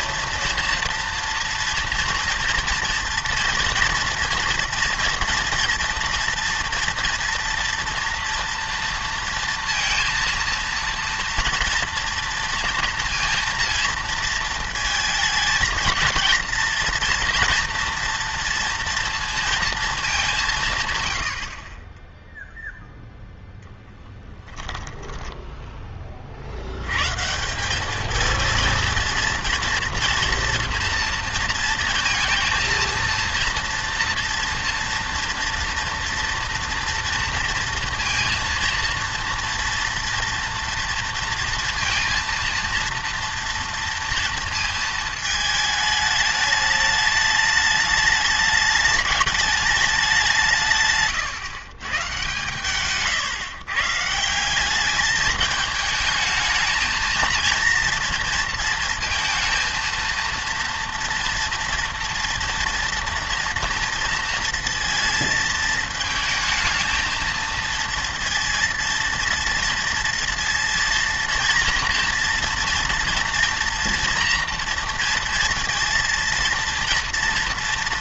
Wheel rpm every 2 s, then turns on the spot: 230, 230, 240, 230, 230, 230, 230, 220, 230, 230, 150, 0, 10, 80, 230, 240, 230, 230, 230, 230, 230, 230, 230, 210, 210, 150, 120, 190, 220, 230, 230, 240, 230, 220, 230, 230, 230, 230, 230.
24-26